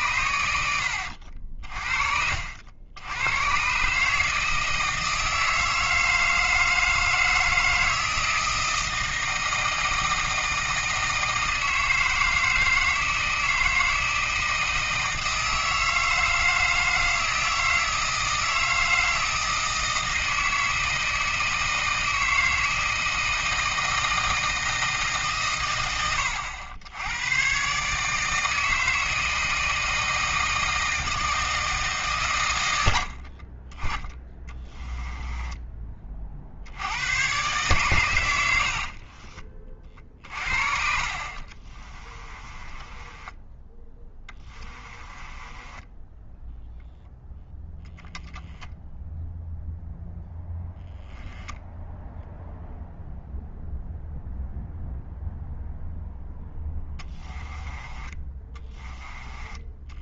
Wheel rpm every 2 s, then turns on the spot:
80, 80, 160, 160, 160, 160, 160, 160, 160, 160, 160, 160, 160, 90, 160, 160, 90, 10, 90, 50, 50, 20, 20, 0, 0, 10, 0, 0, 10, 20.
34-36 38-46 56-58